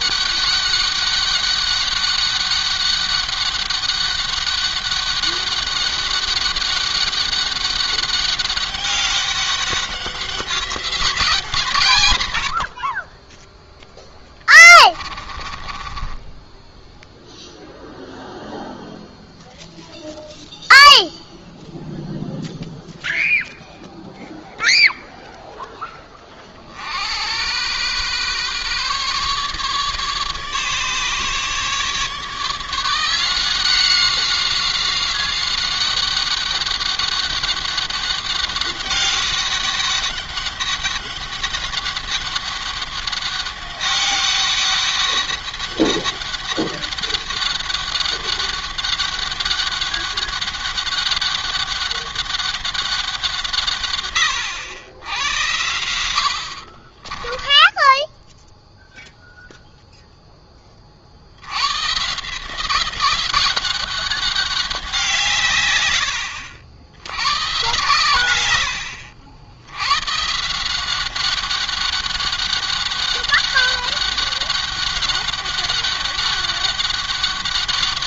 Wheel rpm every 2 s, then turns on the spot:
200, 200, 200, 190, 200, 190, 70, 20, 10, 0, 0, 0, 0, 60, 140, 150, 170, 190, 200, 200, 200, 200, 200, 200, 200, 200, 190, 90, 50, 0, 30, 180, 180, 90, 90, 170, 190, 200, 200.
14-18 56-58